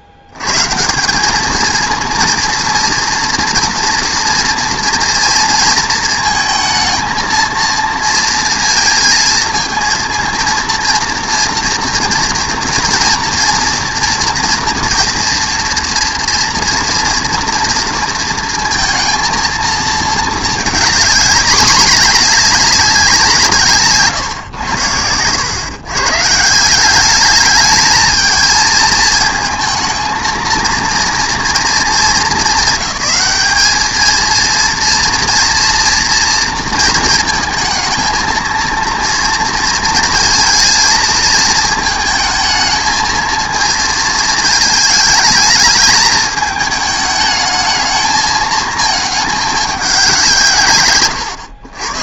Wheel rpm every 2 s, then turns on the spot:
80, 230, 230, 220, 230, 230, 240, 230, 240, 230, 220, 200, 120, 160, 220, 230, 200, 230, 230, 230, 230, 220, 220, 210, 220, 150.
none